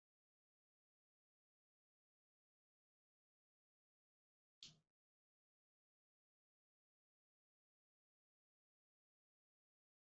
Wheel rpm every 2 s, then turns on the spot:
0, 0, 0, 0, 0.
none